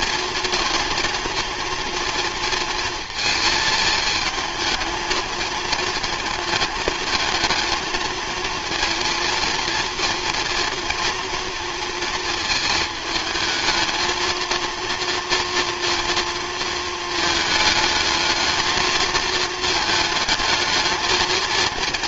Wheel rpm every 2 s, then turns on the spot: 230, 230, 220, 220, 230, 230, 220, 230, 230, 220, 220.
none